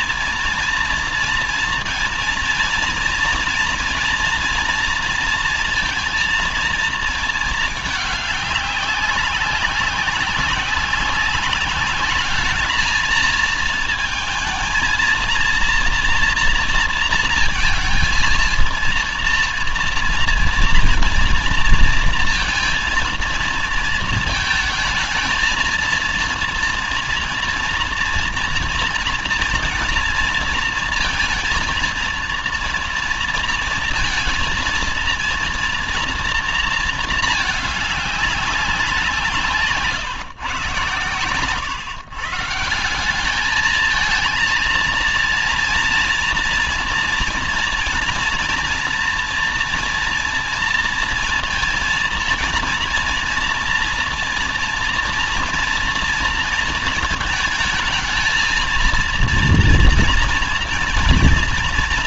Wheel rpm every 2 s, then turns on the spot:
230, 230, 230, 220, 190, 190, 220, 230, 230, 230, 230, 230, 220, 230, 230, 230, 230, 230, 220, 170, 120, 200, 230, 240, 240, 230, 230, 240, 220, 230, 230.
40-42